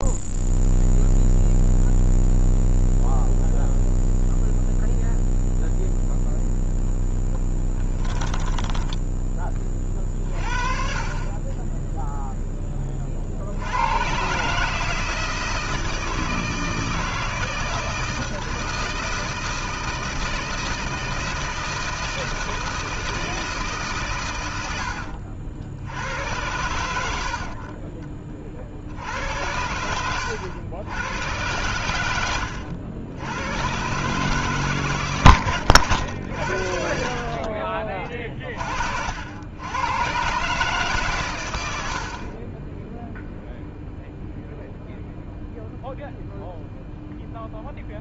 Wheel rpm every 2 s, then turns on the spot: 0, 0, 0, 0, 10, 40, 20, 160, 160, 160, 160, 160, 80, 80, 70, 90, 80, 130, 50, 50, 140, 10, 0, 0.
8-10